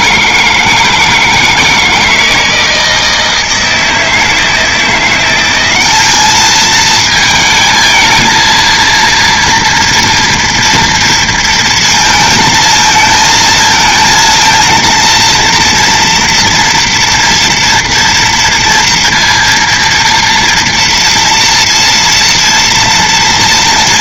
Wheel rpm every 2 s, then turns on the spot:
160, 160, 160, 220, 230, 230, 220, 230, 230, 230, 230, 230.
none